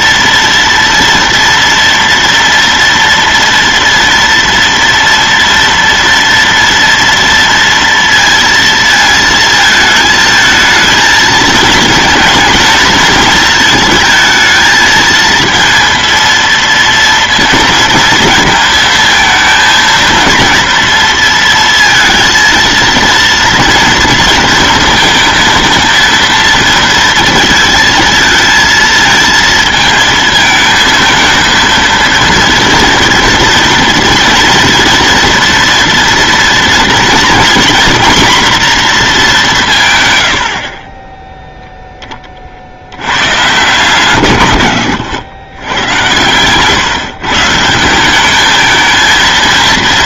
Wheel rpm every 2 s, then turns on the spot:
230, 230, 230, 230, 230, 220, 230, 220, 230, 220, 230, 230, 230, 230, 230, 220, 230, 230, 230, 240, 40, 60, 100, 130, 220.
none